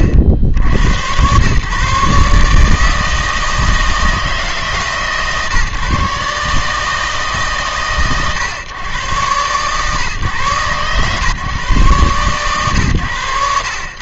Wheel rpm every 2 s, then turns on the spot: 70, 150, 150, 140, 130, 130, 120.
none